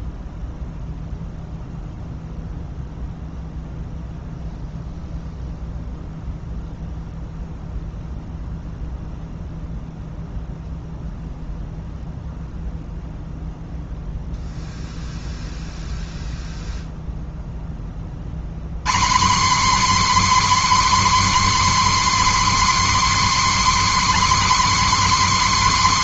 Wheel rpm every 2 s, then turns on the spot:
0, 0, 0, 0, 0, 0, 0, 0, 0, 170, 290, 290, 290.
none